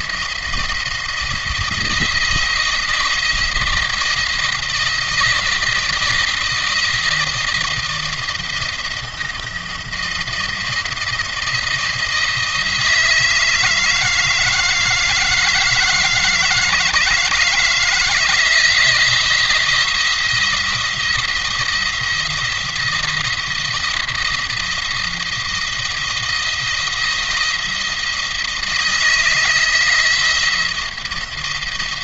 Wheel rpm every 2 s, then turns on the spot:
170, 170, 170, 170, 170, 170, 160, 160, 160, 170, 170, 170, 170, 170, 160, 170.
none